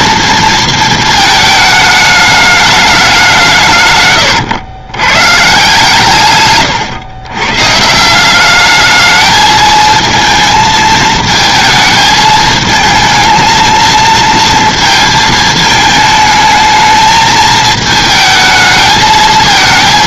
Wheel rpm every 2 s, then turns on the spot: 220, 210, 120, 130, 210, 220, 220, 230, 220, 220.
6-8